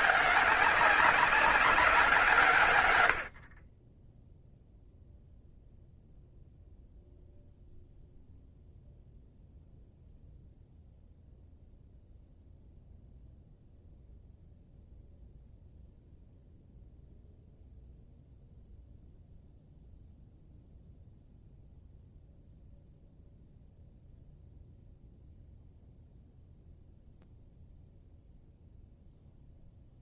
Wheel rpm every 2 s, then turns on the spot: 200, 110, 0, 0, 0, 0, 0, 0, 0, 0, 0, 0, 0, 0, 0.
none